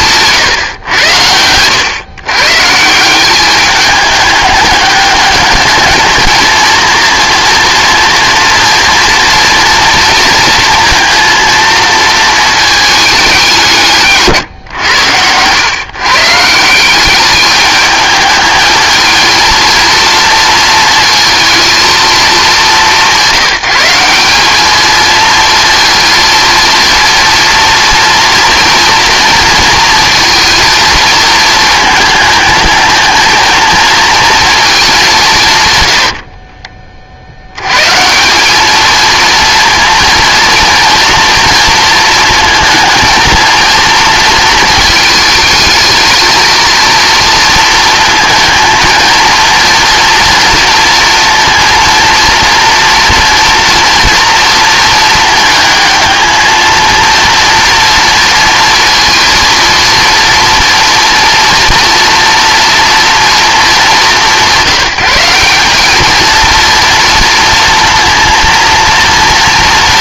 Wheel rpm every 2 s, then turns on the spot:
110, 170, 200, 230, 230, 230, 210, 130, 180, 220, 230, 190, 220, 230, 230, 230, 220, 220, 30, 210, 230, 220, 220, 230, 230, 230, 230, 230, 230, 230, 230, 230, 180, 230, 230.
none